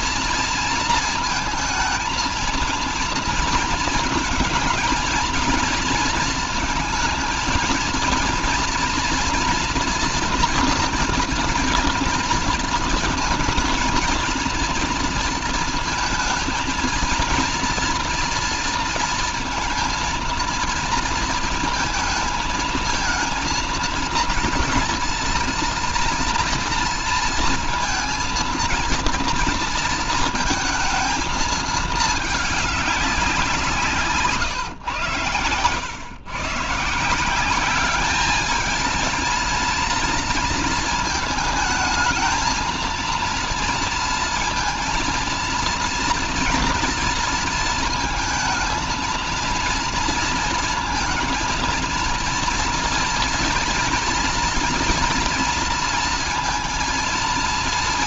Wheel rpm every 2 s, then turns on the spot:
230, 230, 220, 230, 240, 230, 230, 230, 220, 230, 230, 230, 230, 230, 230, 230, 200, 130, 140, 220, 230, 230, 230, 230, 220, 230, 230, 230, 230.
none